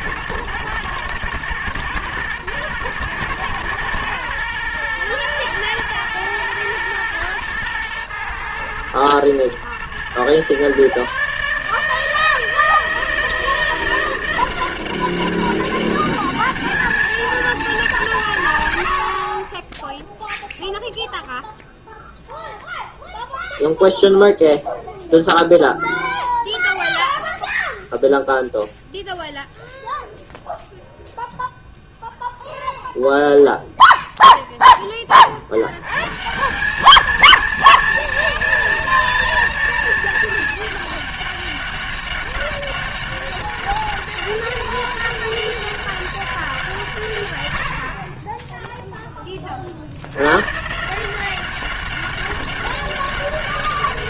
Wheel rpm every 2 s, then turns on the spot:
110, 110, 110, 110, 120, 120, 160, 180, 210, 130, 0, 0, 0, 0, 0, 0, 0, 10, 180, 230, 220, 200, 200, 180, 10, 130, 200.
none